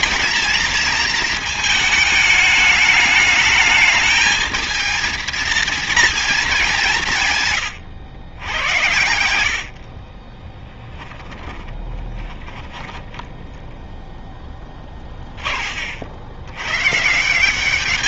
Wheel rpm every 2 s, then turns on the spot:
220, 210, 220, 190, 100, 10, 20, 10, 120.
8-14